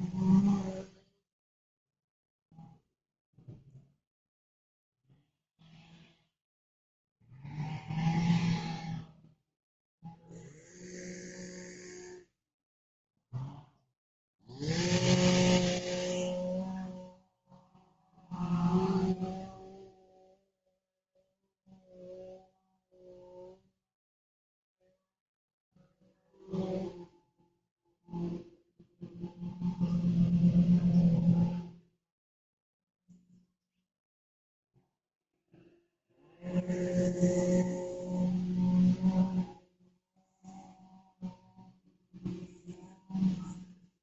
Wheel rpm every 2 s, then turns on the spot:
0, 0, 0, 0, 0, 0, 0, 0, 0, 0, 0, 0, 0, 0, 0, 0, 0, 0, 0, 0, 0, 0.
none